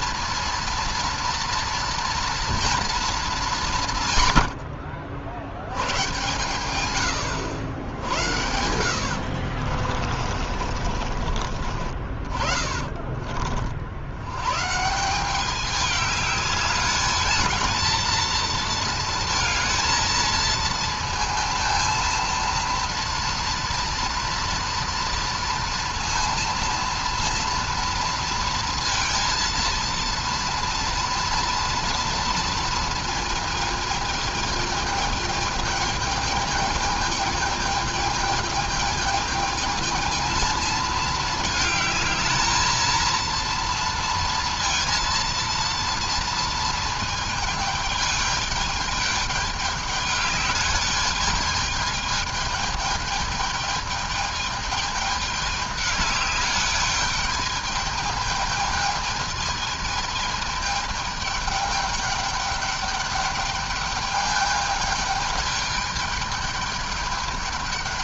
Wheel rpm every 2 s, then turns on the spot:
230, 230, 100, 110, 70, 40, 40, 110, 210, 230, 230, 230, 230, 230, 230, 230, 230, 220, 220, 210, 220, 220, 230, 230, 210, 210, 210, 210, 210, 220, 220, 210, 210, 210.
8-14